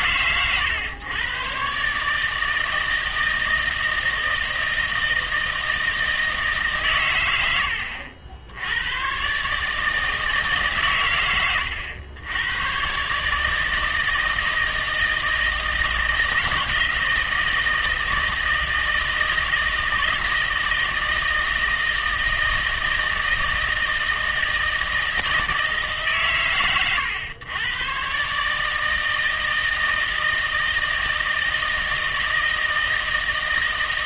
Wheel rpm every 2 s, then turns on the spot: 120, 160, 160, 130, 100, 120, 130, 160, 160, 160, 160, 160, 160, 130, 160, 160, 160.
none